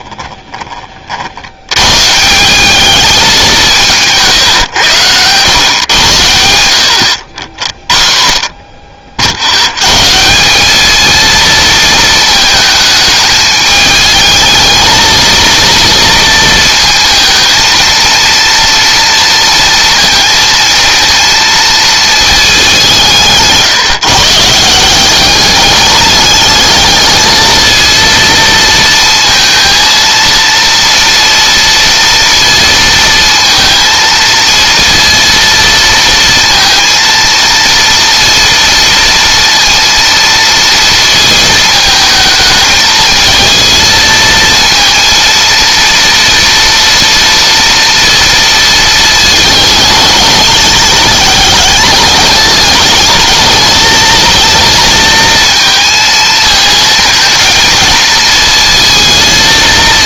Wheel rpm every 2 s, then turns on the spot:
40, 200, 120, 80, 60, 210, 220, 220, 230, 230, 230, 180, 180, 220, 230, 230, 230, 230, 230, 230, 230, 220, 230, 230, 220, 210, 210, 230, 220, 230.
none